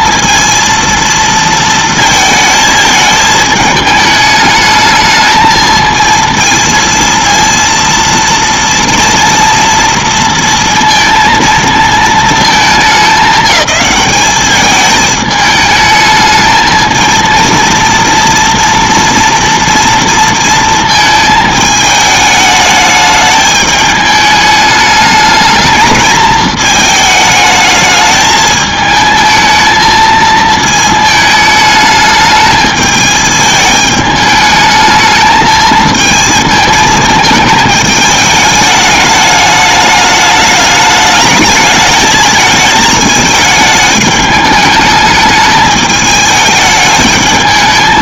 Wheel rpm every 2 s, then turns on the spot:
230, 220, 210, 230, 230, 230, 220, 210, 220, 230, 230, 210, 210, 220, 220, 220, 210, 210, 220, 210, 210, 220, 210, 210.
none